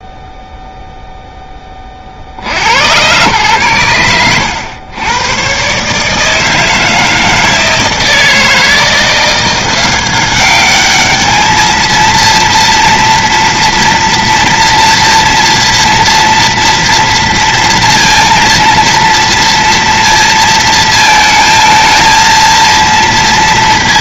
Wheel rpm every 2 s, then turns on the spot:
0, 90, 90, 160, 160, 200, 230, 230, 230, 230, 230, 230.
none